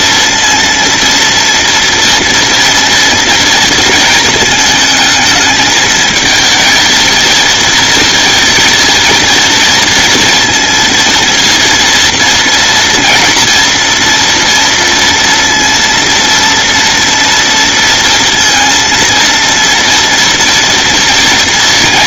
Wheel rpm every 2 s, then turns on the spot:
230, 230, 220, 220, 230, 230, 230, 230, 230, 230, 230.
none